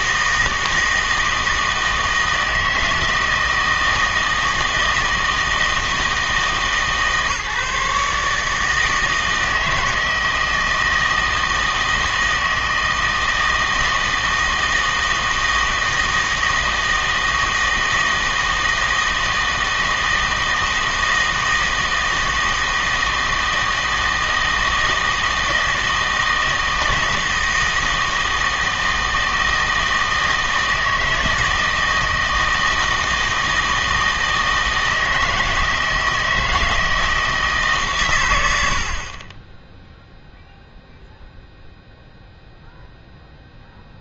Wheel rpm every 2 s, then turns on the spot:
160, 160, 160, 160, 150, 160, 160, 160, 160, 160, 160, 160, 160, 160, 160, 160, 160, 160, 160, 80, 0, 0.
none